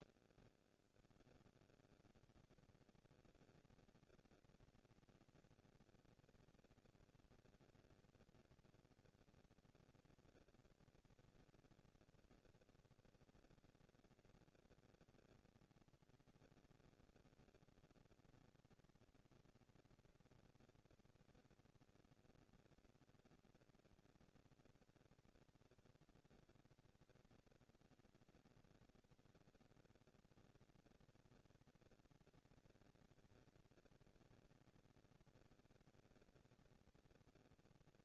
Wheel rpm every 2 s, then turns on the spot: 50, 210, 230, 230, 230, 220, 230, 230, 230, 230, 230, 230, 220, 200, 200, 220, 230, 230, 230.
none